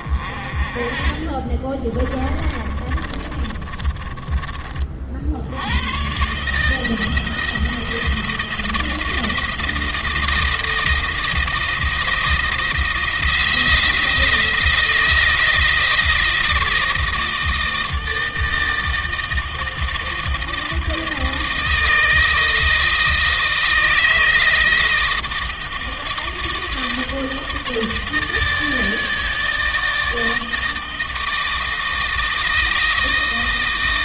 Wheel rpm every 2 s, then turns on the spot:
30, 20, 40, 160, 170, 170, 170, 170, 160, 160, 160, 160, 160, 160, 160, 160, 160.
0-4